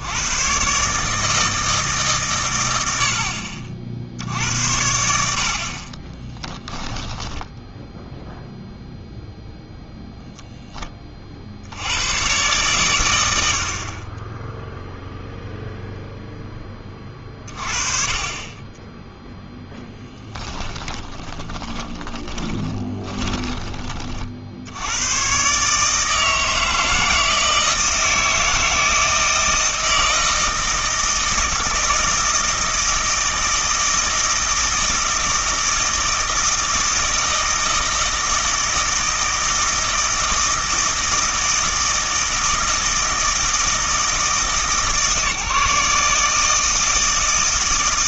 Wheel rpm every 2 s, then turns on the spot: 120, 100, 80, 10, 0, 0, 110, 10, 10, 20, 20, 20, 60, 160, 160, 160, 160, 160, 160, 160, 160, 160, 160, 160.
6-8 20-24